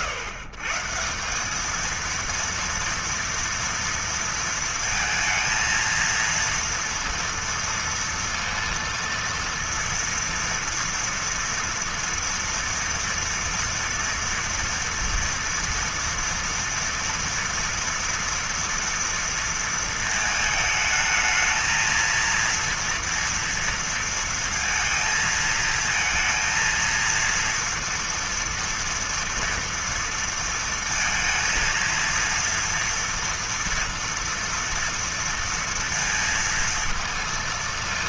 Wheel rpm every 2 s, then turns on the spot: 140, 230, 230, 230, 230, 230, 230, 230, 230, 230, 220, 230, 230, 230, 230, 230, 230, 230, 230.
none